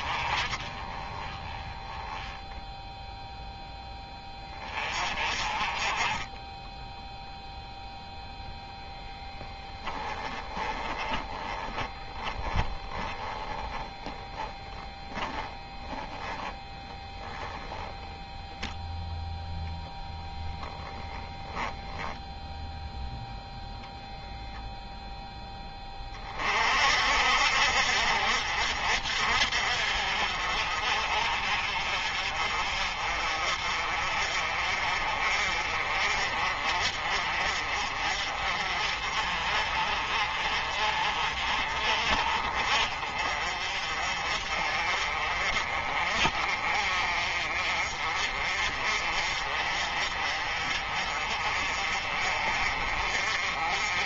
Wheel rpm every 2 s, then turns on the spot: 20, 0, 40, 0, 10, 20, 10, 20, 10, 0, 0, 0, 0, 50, 60, 50, 40, 40, 40, 40, 40, 40, 40, 40, 40, 40, 40.
10-18